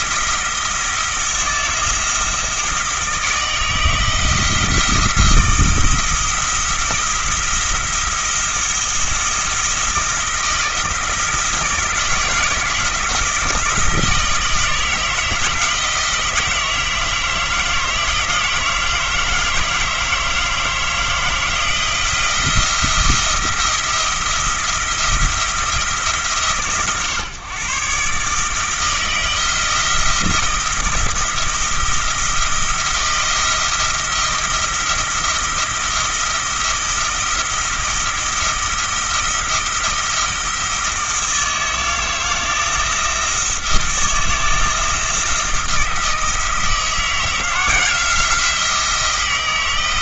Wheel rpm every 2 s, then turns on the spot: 160, 160, 160, 170, 170, 170, 160, 160, 160, 160, 160, 170, 160, 140, 160, 170, 170, 160, 170, 170, 160, 170, 160, 160, 170.
none